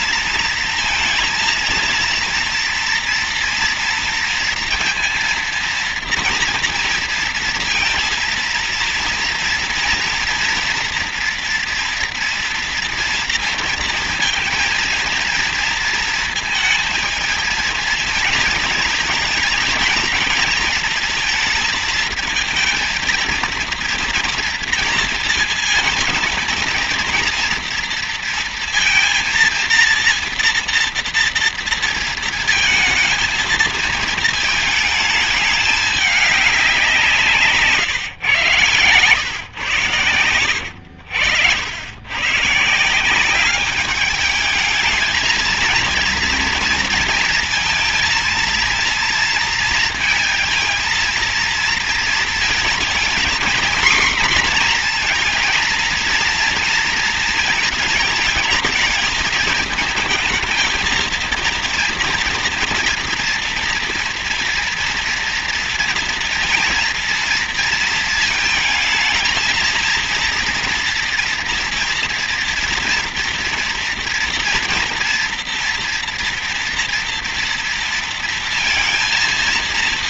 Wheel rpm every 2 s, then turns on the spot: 230, 230, 230, 230, 230, 230, 230, 230, 220, 220, 230, 230, 230, 230, 230, 230, 220, 210, 170, 110, 80, 170, 220, 230, 230, 230, 230, 240, 230, 220, 230, 240, 230, 230, 220, 230, 230, 230, 230, 230.
40-42